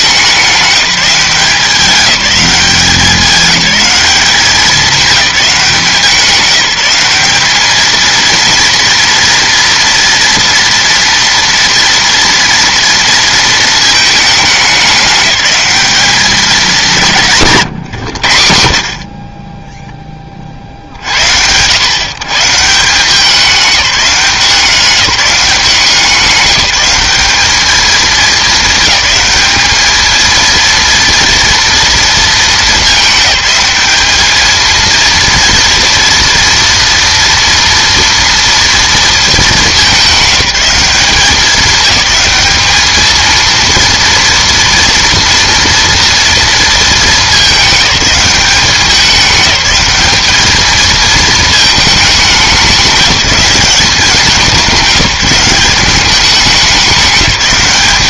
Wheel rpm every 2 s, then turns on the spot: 190, 200, 200, 190, 230, 230, 230, 200, 180, 60, 50, 150, 180, 180, 210, 230, 220, 220, 230, 230, 200, 220, 230, 230, 200, 220, 200, 200, 190.
none